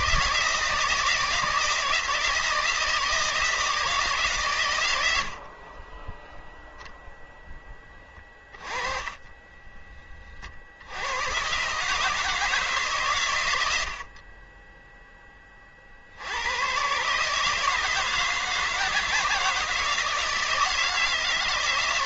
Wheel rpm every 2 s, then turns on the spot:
160, 160, 100, 0, 20, 90, 130, 10, 130, 160, 160.
8-10